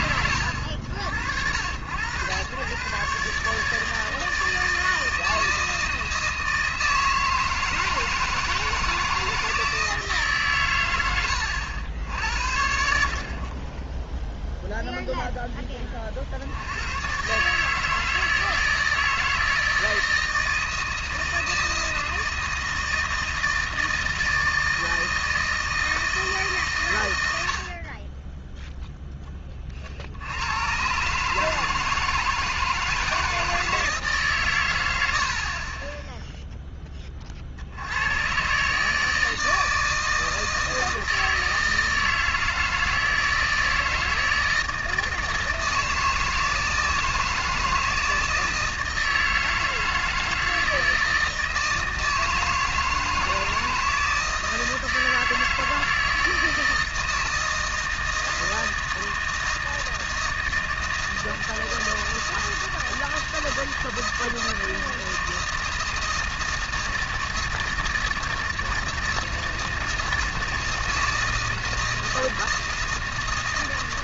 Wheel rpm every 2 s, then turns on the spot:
90, 140, 160, 160, 160, 100, 40, 0, 130, 160, 160, 160, 160, 110, 0, 130, 160, 90, 20, 150, 160, 160, 160, 160, 160, 160, 160, 160, 160, 160, 160, 160, 160, 160, 160, 160, 160.
none